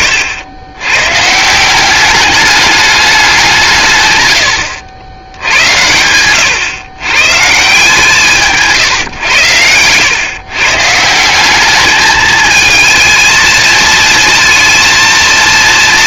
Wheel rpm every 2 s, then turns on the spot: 120, 200, 80, 120, 130, 150, 220, 230.
none